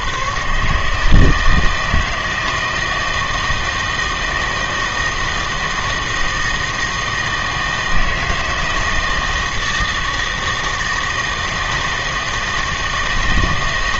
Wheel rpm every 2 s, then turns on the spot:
150, 160, 160, 160, 160, 160, 160.
none